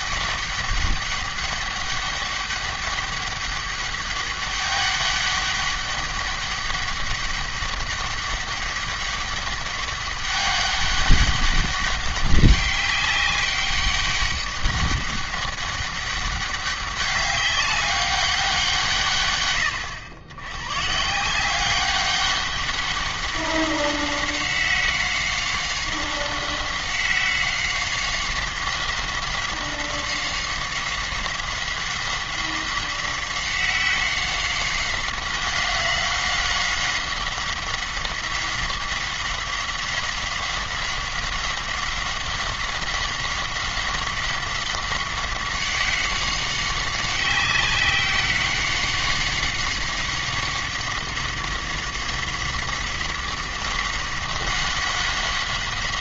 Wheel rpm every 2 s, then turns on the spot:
200, 200, 200, 200, 200, 200, 200, 200, 200, 150, 130, 200, 190, 190, 190, 190, 190, 190, 190, 190, 190, 190, 190, 190, 190, 190, 190, 190.
none